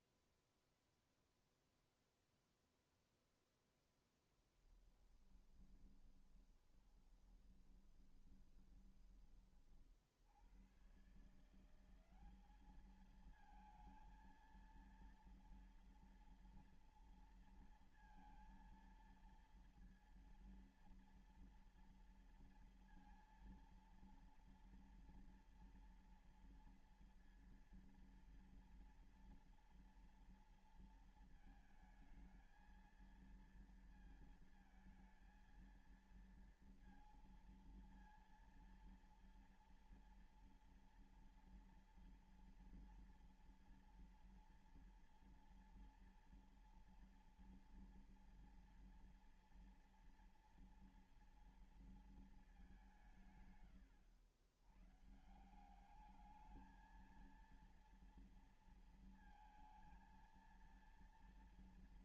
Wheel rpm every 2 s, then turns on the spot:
0, 0, 10, 20, 20, 80, 200, 230, 230, 230, 230, 230, 230, 230, 230, 230, 220, 230, 230, 230, 230, 230, 230, 230, 230, 230, 210, 100, 210, 230, 230.
4-10